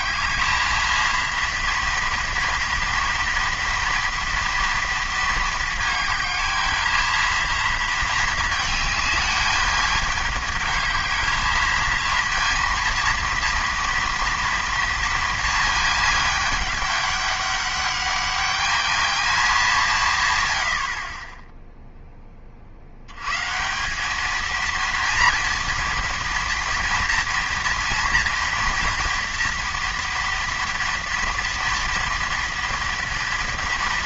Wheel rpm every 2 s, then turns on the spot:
230, 230, 230, 220, 210, 210, 230, 230, 200, 210, 30, 110, 230, 230, 230, 230, 230.
none